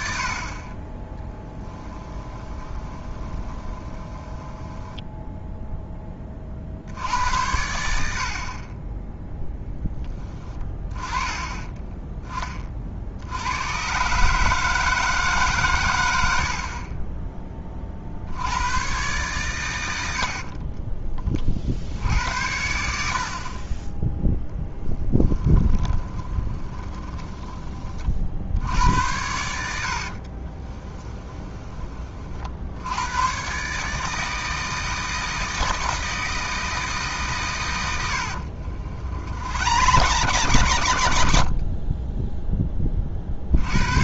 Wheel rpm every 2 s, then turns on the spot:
40, 20, 10, 60, 20, 20, 50, 160, 40, 110, 40, 70, 10, 10, 80, 20, 80, 160, 160, 70, 100, 10.
2-6 20-22 24-28 30-32 38-42